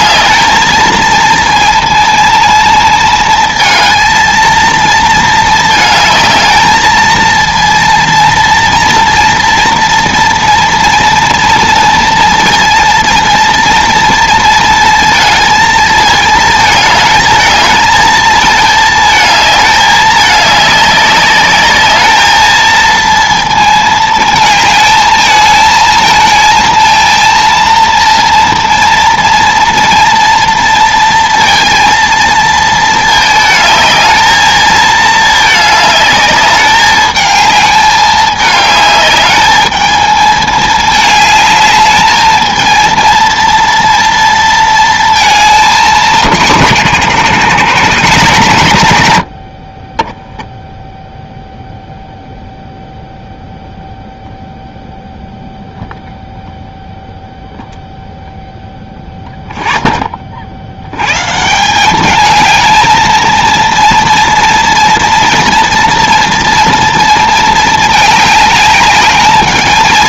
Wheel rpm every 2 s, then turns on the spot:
220, 220, 220, 220, 230, 230, 230, 230, 220, 220, 210, 220, 220, 230, 230, 230, 230, 220, 210, 210, 220, 220, 230, 170, 130, 0, 0, 0, 0, 0, 60, 220, 230, 230, 210.
none